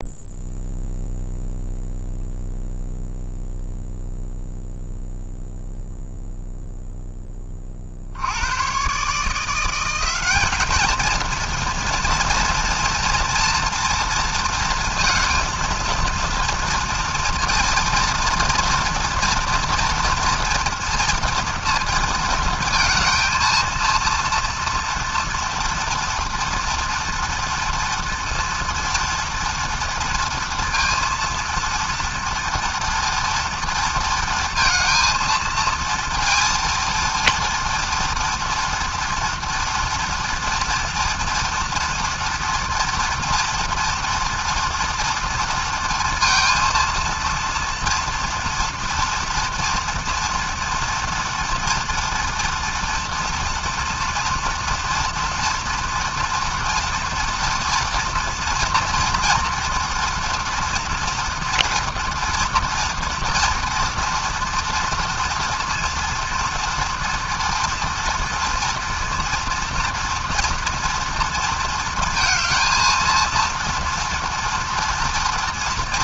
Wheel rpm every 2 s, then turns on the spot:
0, 0, 0, 10, 150, 230, 230, 220, 230, 230, 230, 230, 240, 240, 230, 230, 240, 230, 230, 230, 230, 230, 230, 230, 240, 230, 230, 230, 230, 230, 240, 230, 230, 240, 230, 230, 230, 230.
none